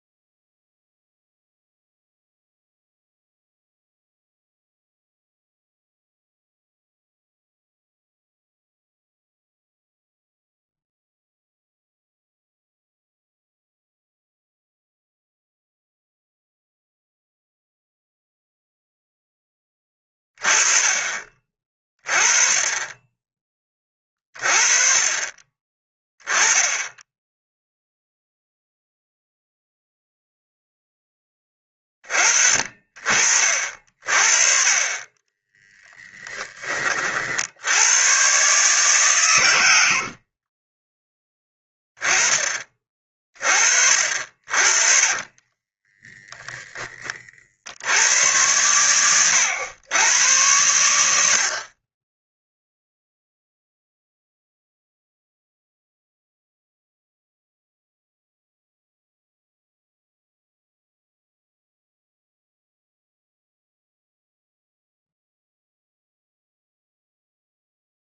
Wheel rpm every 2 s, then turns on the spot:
0, 0, 0, 0, 0, 0, 0, 0, 0, 0, 30, 20, 30, 10, 0, 0, 40, 30, 30, 140, 40, 20, 50, 10, 100, 90, 0, 0, 0, 0, 0, 0, 0, 0.
40-42